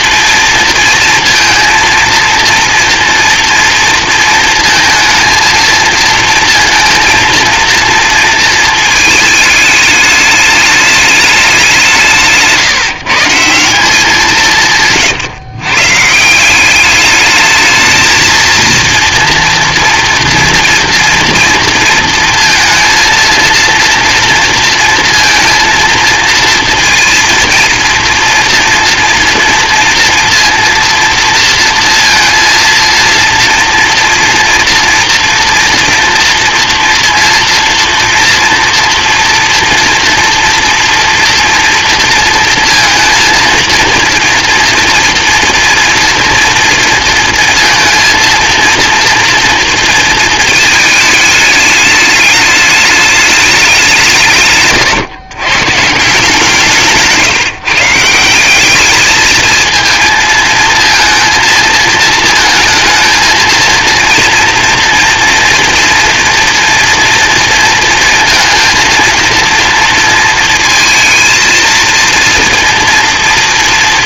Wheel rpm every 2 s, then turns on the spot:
230, 230, 230, 230, 230, 210, 160, 170, 150, 220, 230, 230, 230, 230, 230, 230, 230, 230, 230, 240, 230, 230, 240, 230, 230, 220, 210, 160, 160, 170, 230, 230, 230, 240, 230, 230, 230.
none